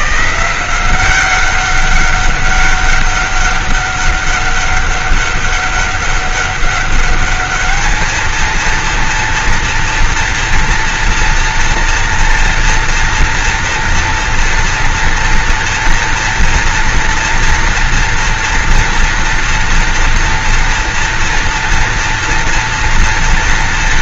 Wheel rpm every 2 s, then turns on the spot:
160, 200, 200, 200, 230, 230, 240, 230, 230, 230, 230, 230.
none